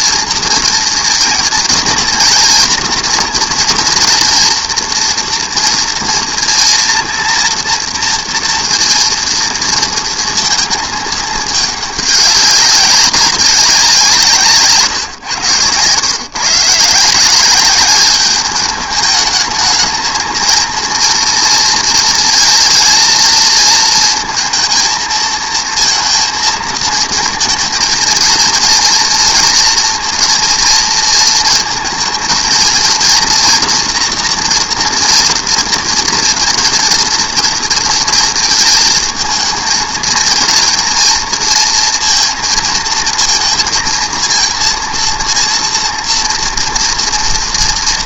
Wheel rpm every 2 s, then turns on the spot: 230, 230, 230, 230, 230, 230, 200, 150, 140, 210, 220, 230, 230, 230, 230, 230, 230, 230, 230, 220, 230, 230, 230, 230.
none